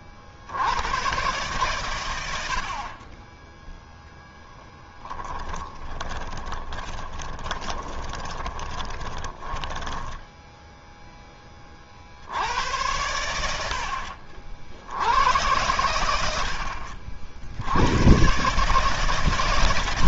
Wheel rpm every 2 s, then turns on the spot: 50, 100, 0, 20, 20, 10, 80, 70, 80, 120.
6-12